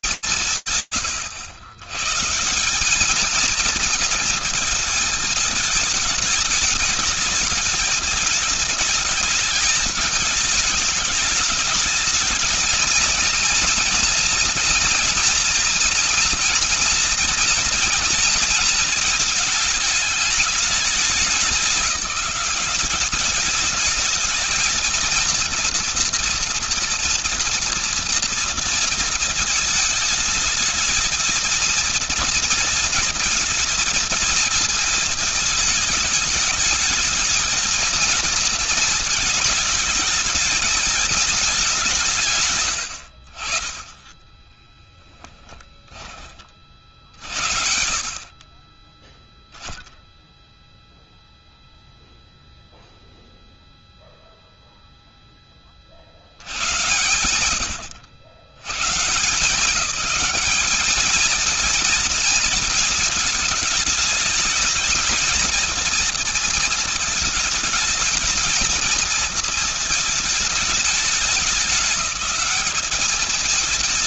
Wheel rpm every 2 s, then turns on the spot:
160, 180, 230, 210, 220, 210, 220, 230, 230, 230, 210, 200, 230, 230, 230, 220, 230, 220, 220, 230, 220, 110, 10, 40, 10, 0, 0, 0, 90, 150, 210, 220, 220, 220, 230, 210, 210.
44-46 56-58